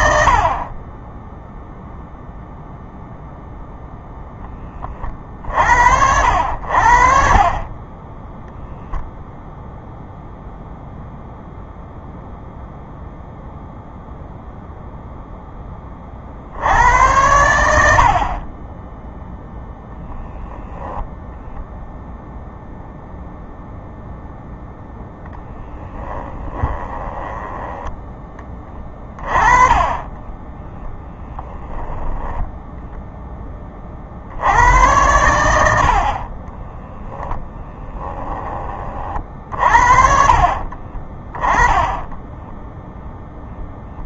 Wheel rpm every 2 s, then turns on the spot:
30, 0, 20, 60, 0, 0, 0, 0, 90, 10, 0, 0, 0, 10, 30, 10, 0, 90, 0, 30, 30, 0.
0-2 26-28 40-42